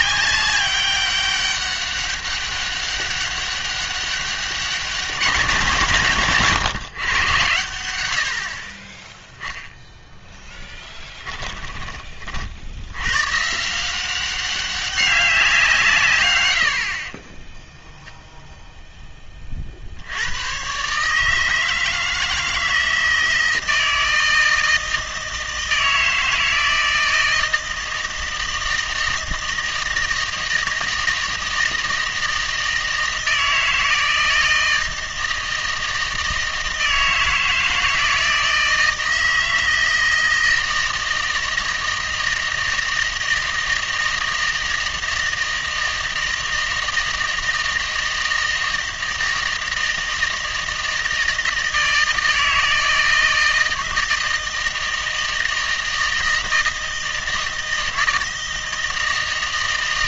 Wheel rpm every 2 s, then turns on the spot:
200, 200, 200, 120, 40, 10, 70, 190, 80, 0, 120, 160, 160, 160, 160, 160, 160, 160, 160, 160, 160, 160, 160, 160, 160, 160, 160, 160, 160, 160.
10-12